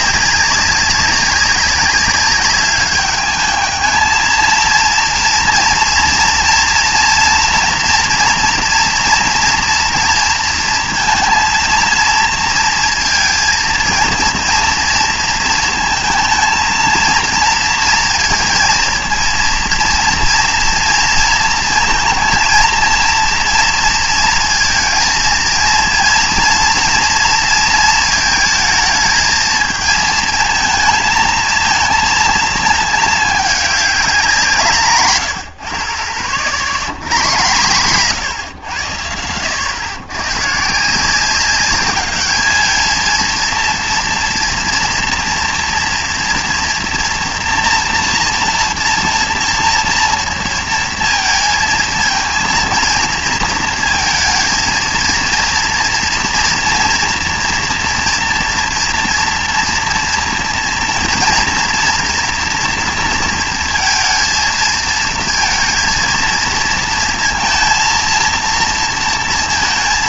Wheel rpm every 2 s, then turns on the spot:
190, 200, 230, 230, 230, 230, 230, 230, 220, 230, 230, 230, 220, 230, 220, 230, 220, 150, 90, 110, 150, 220, 230, 230, 230, 230, 230, 230, 230, 230, 230, 230, 230, 230, 230.
none